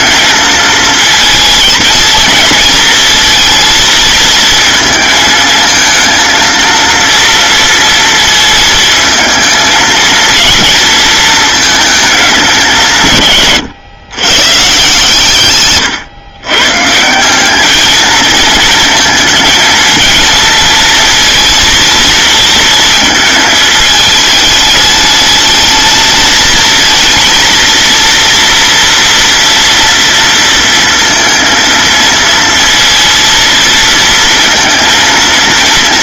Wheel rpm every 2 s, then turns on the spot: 220, 230, 220, 230, 220, 230, 160, 150, 160, 230, 230, 220, 210, 220, 230, 230, 230, 220.
none